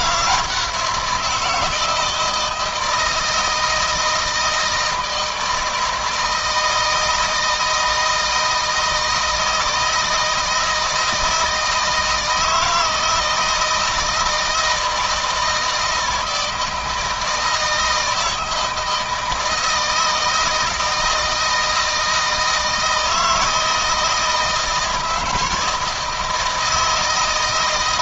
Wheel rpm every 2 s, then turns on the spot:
170, 160, 160, 160, 160, 160, 160, 160, 160, 160, 160, 160, 160, 150.
none